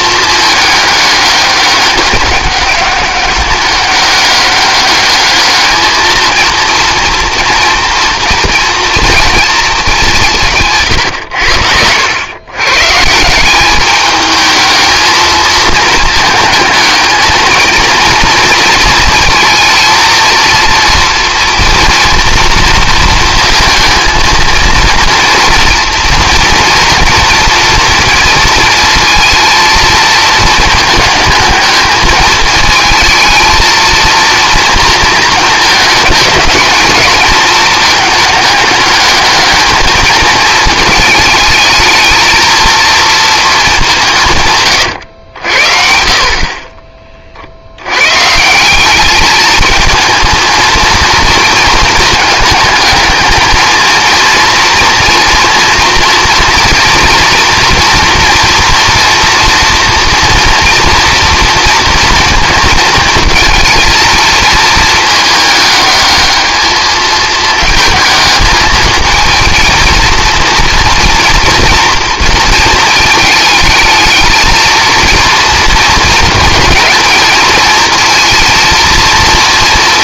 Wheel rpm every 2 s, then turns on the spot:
210, 200, 210, 230, 230, 130, 140, 220, 220, 230, 230, 230, 230, 230, 230, 220, 220, 230, 220, 210, 220, 230, 120, 40, 190, 230, 220, 230, 230, 230, 230, 230, 220, 220, 220, 230, 230, 230, 230, 230.
none